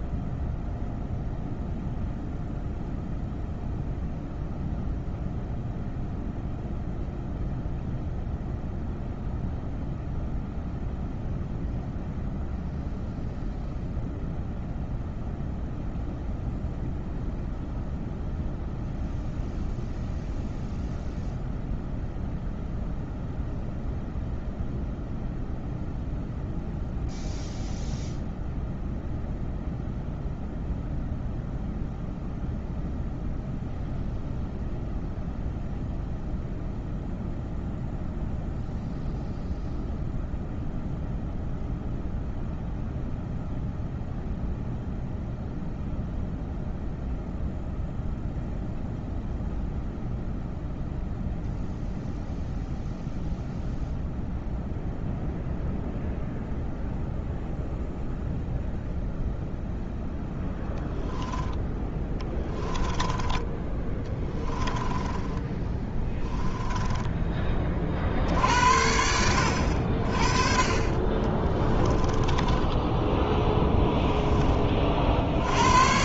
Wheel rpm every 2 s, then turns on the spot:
0, 0, 0, 0, 0, 0, 0, 0, 0, 0, 0, 0, 0, 0, 0, 0, 0, 0, 0, 0, 0, 0, 0, 0, 0, 0, 0, 0, 0, 0, 0, 10, 10, 10, 80, 30, 10, 50.
62-68 72-74